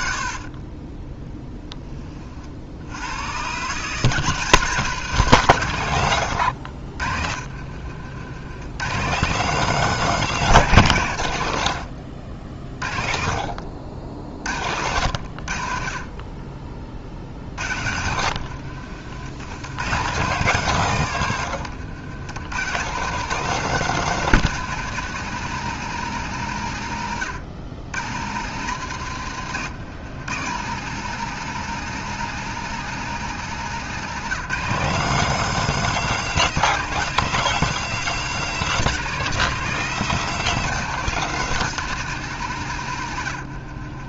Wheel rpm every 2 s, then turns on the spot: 20, 80, 160, 60, 130, 140, 40, 80, 40, 70, 150, 160, 180, 120, 140, 150, 170, 180, 190, 200, 200, 120.
none